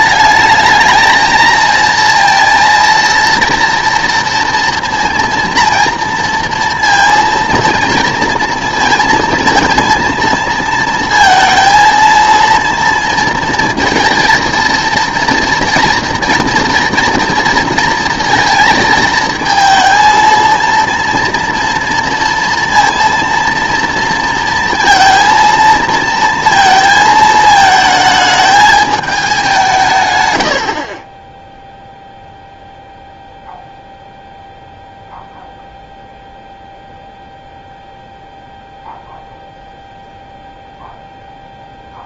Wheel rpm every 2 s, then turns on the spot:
220, 230, 240, 230, 230, 230, 230, 230, 230, 230, 230, 230, 230, 230, 210, 70, 0, 0, 0, 0, 0.
30-32